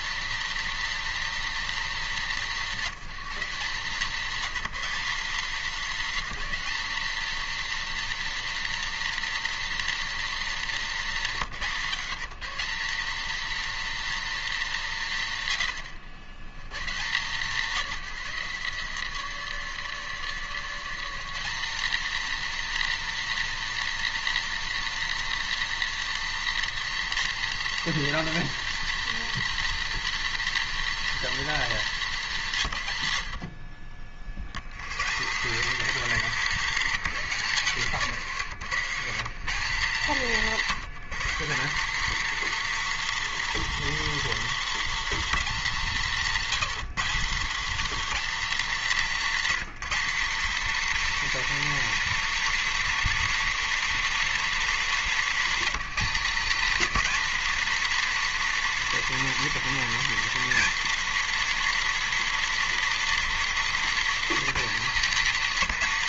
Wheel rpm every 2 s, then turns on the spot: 240, 190, 210, 230, 240, 200, 220, 200, 150, 150, 190, 240, 240, 240, 240, 240, 140, 140, 200, 170, 190, 240, 240, 200, 210, 240, 240, 220, 220, 240, 240, 240, 210.
none